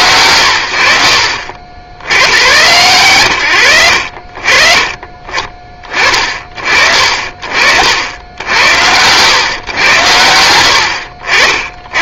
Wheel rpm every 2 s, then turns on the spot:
70, 80, 30, 40, 90, 100.
none